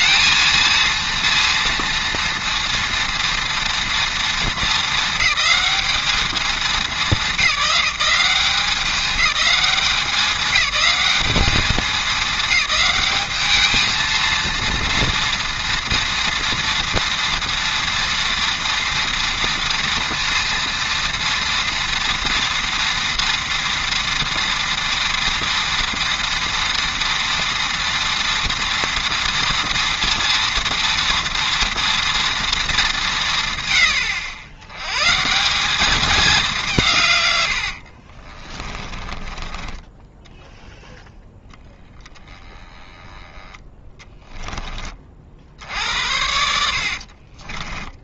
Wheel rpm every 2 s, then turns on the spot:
230, 230, 220, 210, 200, 200, 210, 230, 230, 230, 230, 230, 230, 230, 240, 240, 210, 100, 160, 20, 0, 20, 20, 60.
38-40 46-48